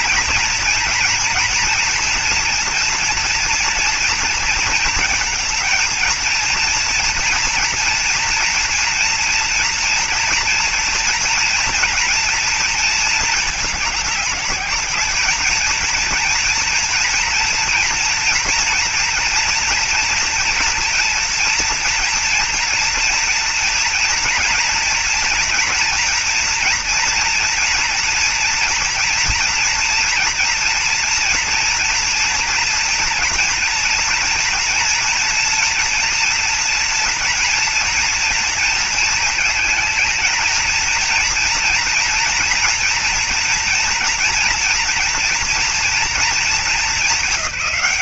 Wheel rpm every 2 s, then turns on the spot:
230, 230, 230, 230, 230, 240, 230, 210, 230, 230, 230, 230, 240, 230, 230, 230, 230, 240, 230, 230, 220, 230, 240, 220.
none